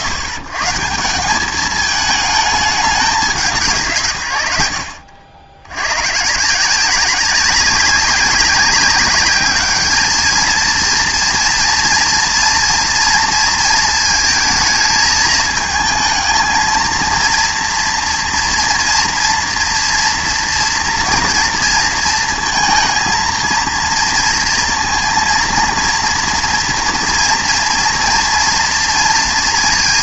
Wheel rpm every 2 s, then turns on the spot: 130, 210, 60, 170, 190, 230, 230, 220, 220, 240, 230, 230, 230, 230, 230.
none